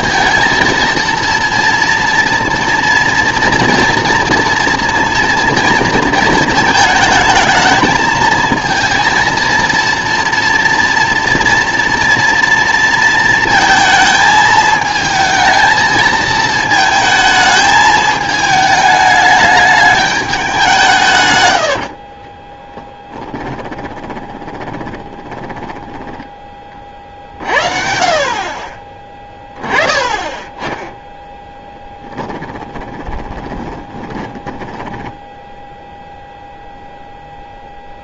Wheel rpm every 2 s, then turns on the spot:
230, 230, 230, 220, 230, 230, 230, 220, 220, 210, 180, 10, 20, 30, 40, 10, 20, 20, 0.
22-26 32-36